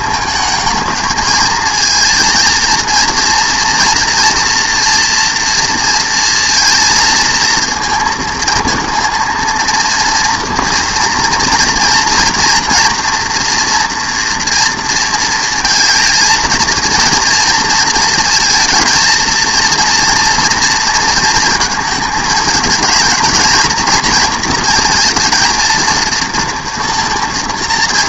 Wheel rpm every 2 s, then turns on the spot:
220, 230, 230, 230, 230, 230, 240, 230, 230, 230, 230, 220, 230, 230.
none